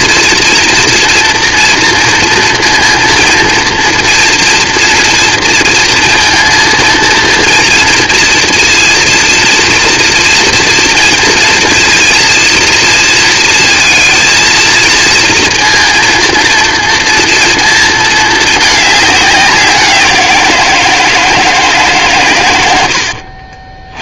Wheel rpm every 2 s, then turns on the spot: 230, 230, 230, 230, 230, 230, 230, 230, 230, 220, 170, 120.
none